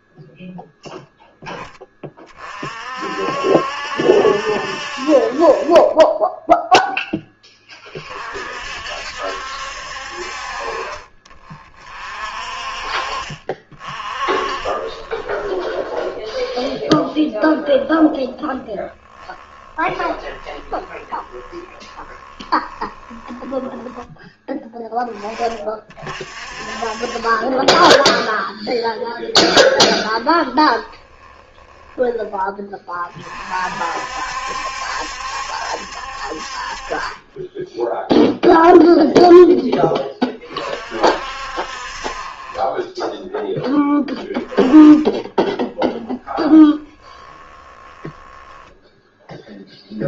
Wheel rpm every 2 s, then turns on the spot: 0, 40, 60, 10, 50, 40, 40, 40, 0, 10, 20, 10, 10, 40, 0, 10, 20, 70, 50, 0, 40, 20, 10, 10, 10.
20-24 30-32 42-50